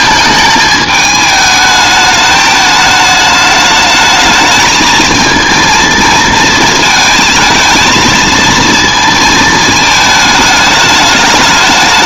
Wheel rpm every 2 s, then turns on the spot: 220, 210, 220, 230, 230, 210.
none